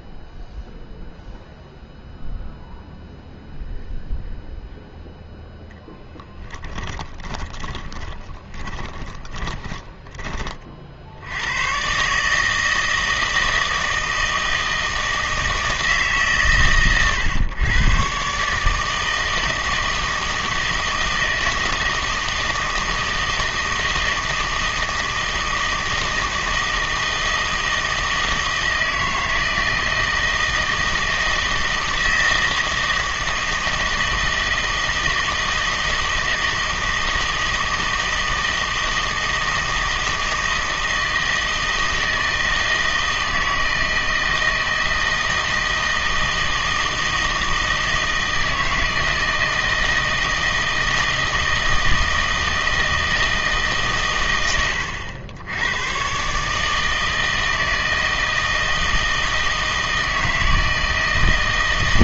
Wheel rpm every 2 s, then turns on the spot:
0, 0, 0, 10, 20, 40, 160, 160, 130, 150, 160, 160, 160, 160, 160, 160, 160, 160, 160, 160, 160, 160, 160, 160, 160, 160, 160, 90, 150, 160, 160.
6-10